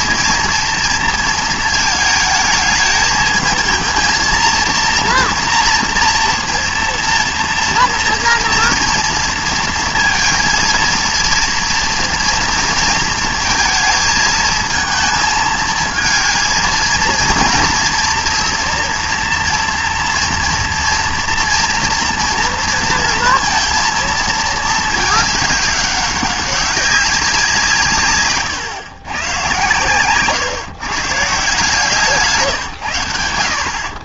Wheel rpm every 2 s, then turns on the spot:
230, 220, 230, 230, 230, 230, 230, 220, 230, 230, 230, 230, 210, 200, 130, 130, 130.
none